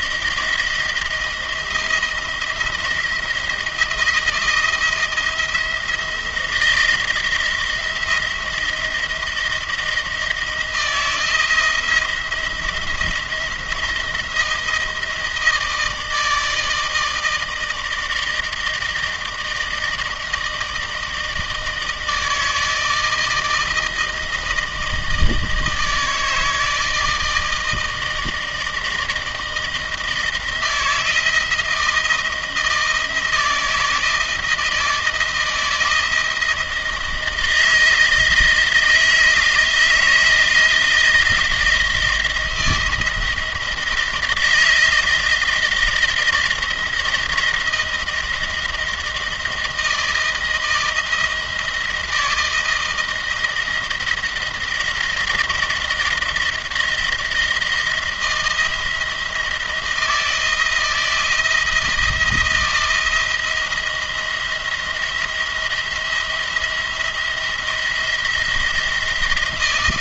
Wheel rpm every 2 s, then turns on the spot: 170, 160, 160, 160, 170, 160, 170, 170, 160, 160, 160, 160, 160, 160, 160, 160, 160, 160, 170, 160, 160, 160, 160, 160, 160, 160, 160, 170, 170, 160, 160, 170, 170, 170, 170.
none